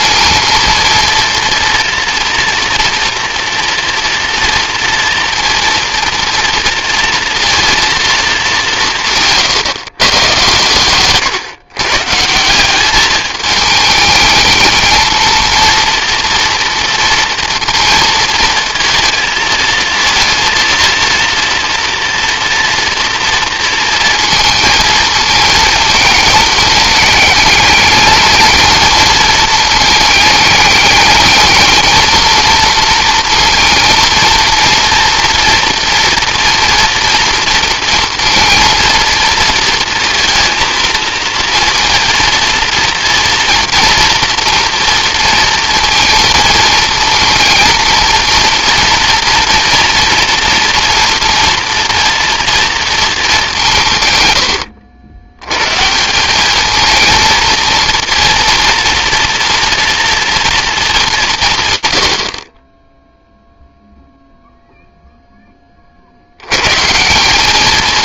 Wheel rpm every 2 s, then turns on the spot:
230, 230, 240, 230, 140, 140, 210, 230, 230, 220, 230, 230, 220, 210, 220, 220, 230, 230, 230, 230, 230, 230, 230, 230, 230, 240, 180, 110, 230, 230, 160, 0, 20, 210.
none